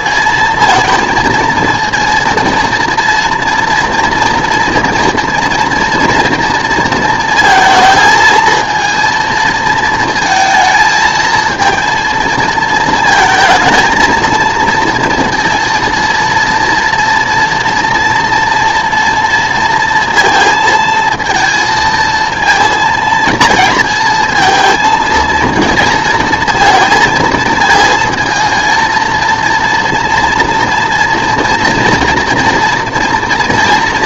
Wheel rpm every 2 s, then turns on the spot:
230, 230, 230, 230, 220, 220, 230, 230, 230, 230, 220, 230, 220, 220, 220, 230, 230.
none